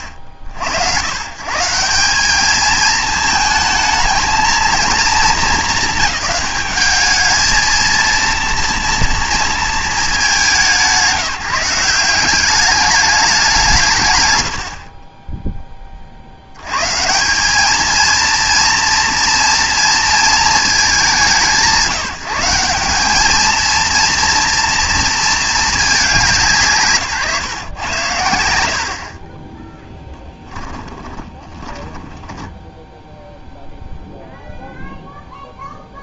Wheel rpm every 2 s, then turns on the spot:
90, 210, 220, 210, 230, 180, 200, 90, 110, 230, 200, 190, 230, 170, 70, 10, 0, 0.
30-32